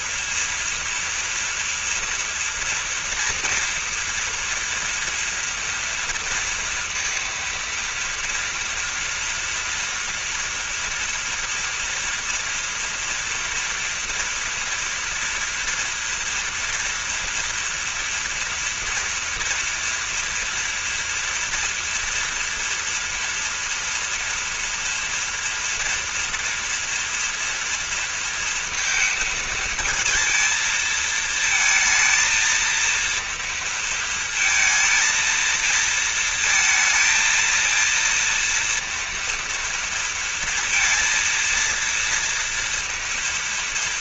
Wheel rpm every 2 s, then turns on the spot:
230, 230, 240, 230, 230, 230, 230, 230, 240, 230, 230, 230, 230, 230, 230, 220, 230, 230, 230, 230, 230, 230.
none